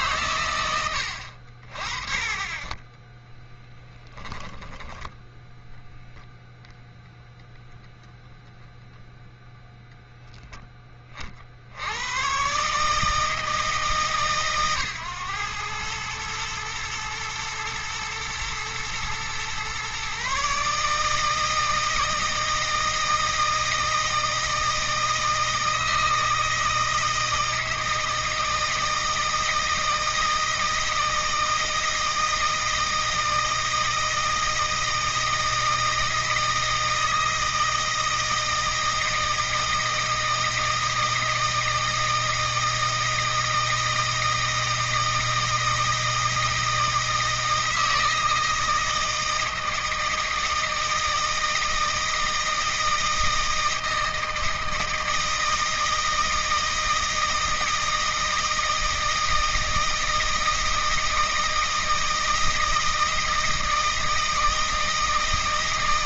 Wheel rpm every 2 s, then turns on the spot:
90, 20, 10, 0, 0, 20, 140, 130, 110, 120, 150, 160, 160, 160, 160, 160, 160, 160, 160, 160, 160, 160, 160, 160, 160, 160, 160, 160, 160, 160, 160, 160, 160.
2-4